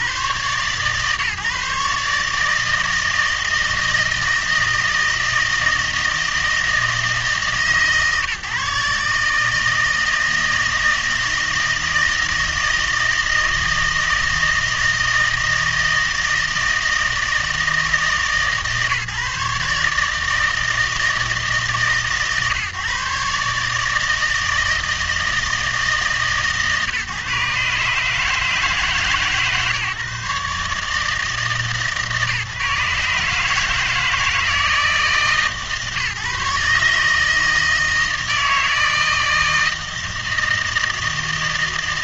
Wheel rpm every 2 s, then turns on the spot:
130, 160, 160, 160, 150, 160, 160, 160, 160, 150, 160, 140, 160, 150, 150, 150, 150, 150, 150, 160, 160.
none